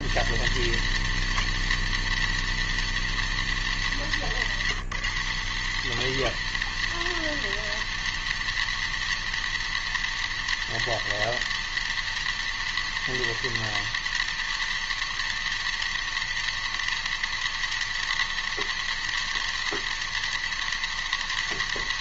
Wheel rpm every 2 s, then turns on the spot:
240, 240, 220, 240, 240, 240, 240, 240, 240, 240, 240.
none